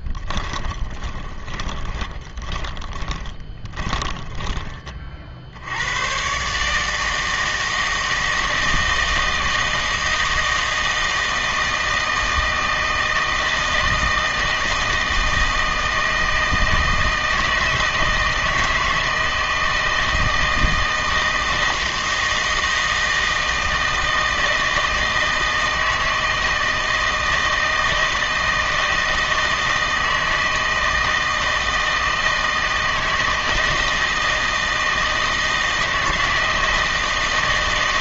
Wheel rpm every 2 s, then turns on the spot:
20, 20, 20, 140, 160, 160, 160, 160, 160, 160, 160, 160, 160, 160, 160, 160, 160, 160, 160.
0-6